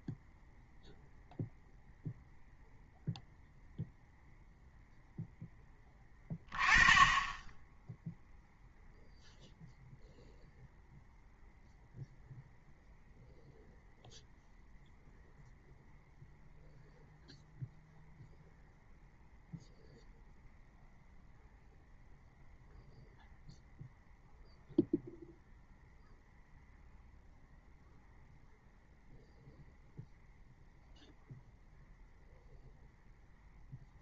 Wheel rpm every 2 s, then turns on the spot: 0, 0, 0, 20, 0, 0, 0, 0, 0, 0, 0, 0, 0, 0, 0, 0, 0.
none